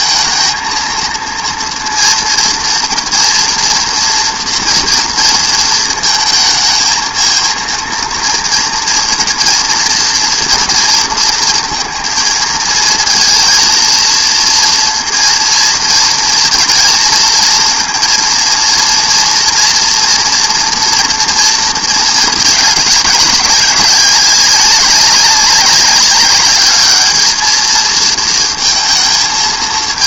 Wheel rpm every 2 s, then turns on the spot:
230, 230, 230, 220, 230, 230, 220, 230, 230, 230, 230, 210, 190, 200, 230.
none